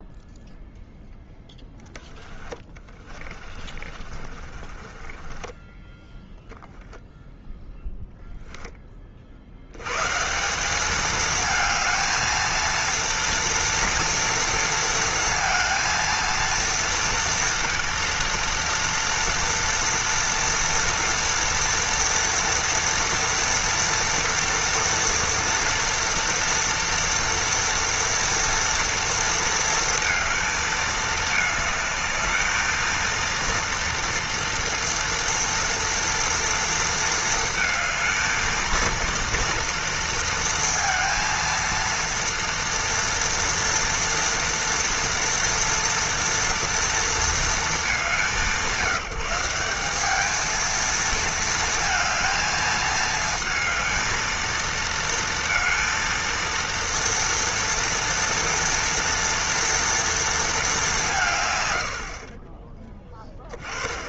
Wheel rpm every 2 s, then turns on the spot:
0, 30, 20, 0, 10, 190, 230, 230, 230, 230, 230, 230, 230, 230, 230, 220, 220, 240, 230, 230, 230, 230, 230, 230, 170, 220, 220, 220, 230, 230, 210, 20.
2-6